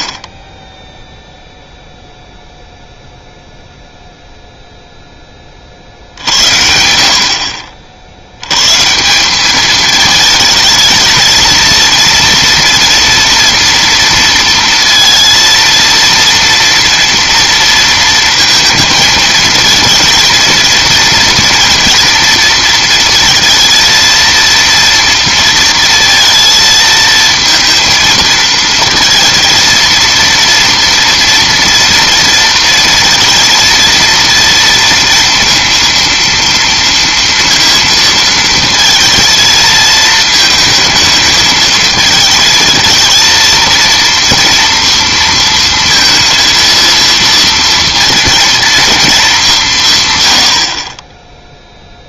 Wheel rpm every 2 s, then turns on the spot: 10, 0, 0, 60, 130, 220, 230, 230, 230, 220, 230, 230, 230, 230, 230, 230, 230, 230, 230, 220, 220, 220, 230, 230, 230, 50.
none